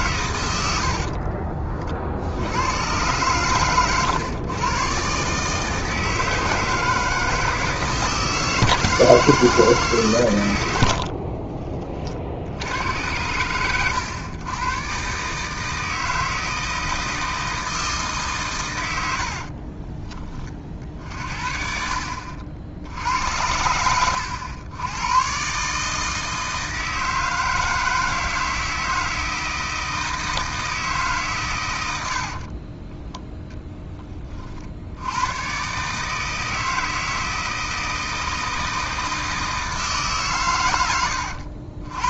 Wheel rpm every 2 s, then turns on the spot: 60, 110, 130, 160, 160, 60, 90, 130, 160, 90, 50, 70, 100, 160, 160, 150, 20, 100, 160, 160, 90.
0-2 10-12 18-20 32-34